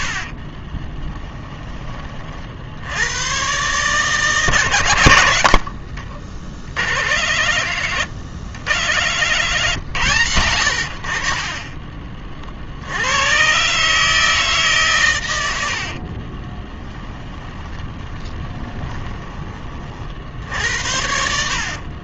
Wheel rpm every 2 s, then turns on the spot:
20, 90, 110, 70, 90, 70, 70, 130, 20, 20, 60.
0-2 16-20